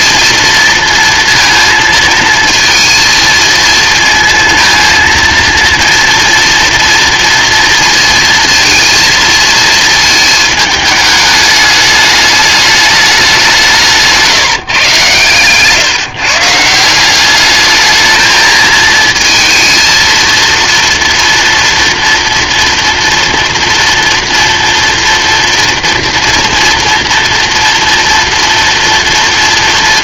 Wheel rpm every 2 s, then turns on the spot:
230, 220, 230, 230, 230, 220, 210, 150, 150, 220, 230, 230, 230, 230, 230.
none